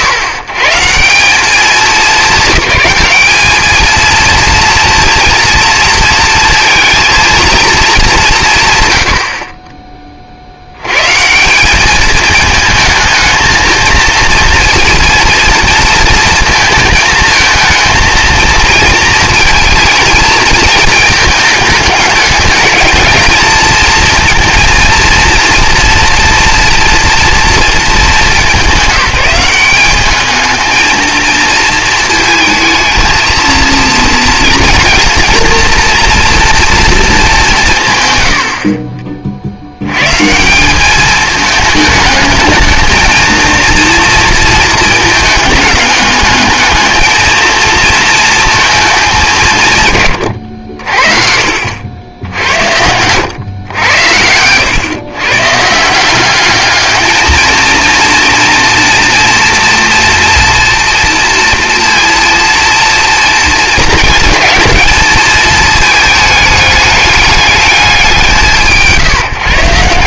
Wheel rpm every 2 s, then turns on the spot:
120, 210, 230, 230, 140, 100, 220, 230, 220, 230, 220, 210, 230, 230, 170, 220, 220, 230, 230, 50, 200, 220, 220, 220, 220, 70, 80, 100, 210, 230, 230, 230, 220, 210, 160.
none